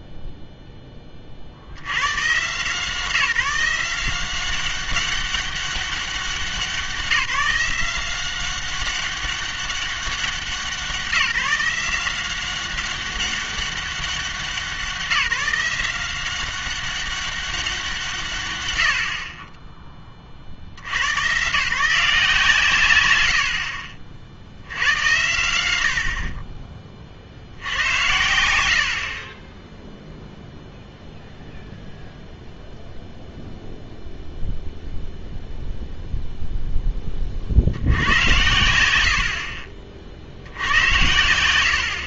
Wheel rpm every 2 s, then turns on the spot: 10, 150, 190, 190, 190, 180, 190, 180, 190, 110, 70, 130, 80, 30, 70, 0, 0, 0, 0, 60, 90.
none